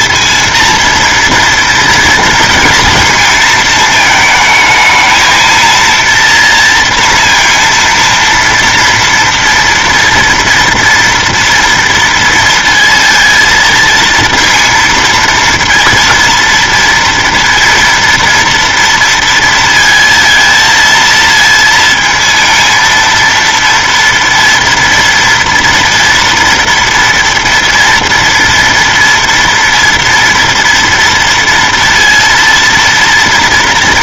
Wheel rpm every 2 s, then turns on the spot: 230, 230, 220, 230, 230, 230, 230, 230, 230, 230, 230, 230, 230, 240, 230, 240, 230.
none